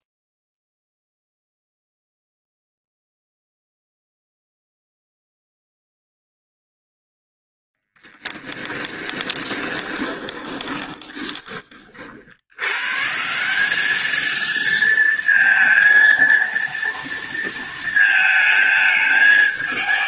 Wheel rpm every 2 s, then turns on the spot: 0, 0, 0, 0, 10, 20, 80, 220, 230, 220.
8-12